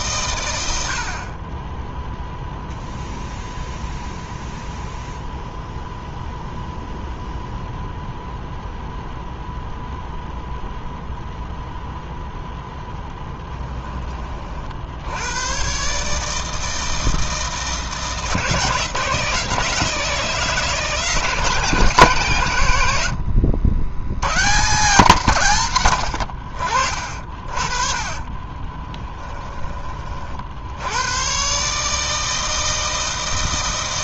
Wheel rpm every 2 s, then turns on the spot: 90, 0, 0, 0, 0, 0, 0, 60, 160, 160, 160, 90, 160, 50, 20, 80, 160.
28-30